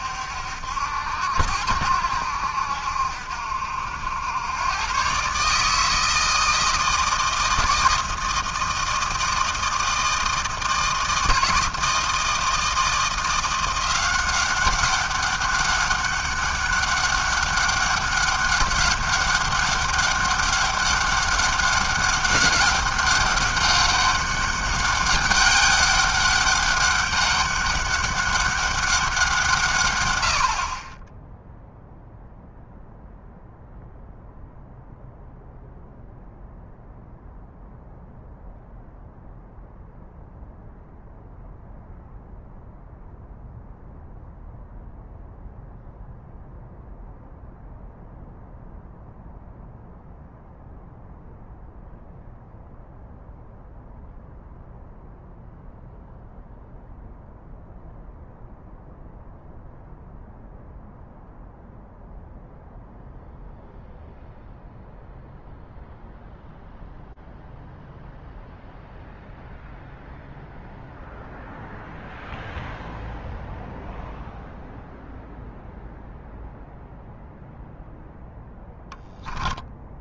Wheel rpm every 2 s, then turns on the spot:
70, 70, 110, 160, 160, 160, 160, 190, 200, 200, 200, 200, 200, 200, 200, 70, 0, 0, 0, 0, 0, 0, 0, 0, 0, 0, 0, 0, 0, 0, 0, 0, 0, 0, 0, 0, 0, 0, 0, 0.
none